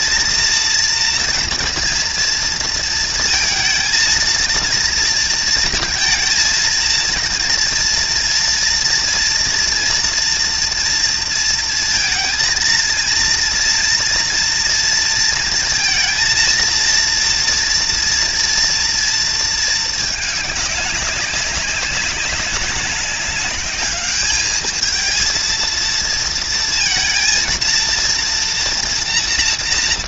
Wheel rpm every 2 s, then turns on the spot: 230, 220, 230, 230, 230, 230, 230, 230, 230, 230, 200, 200, 220, 230, 230.
none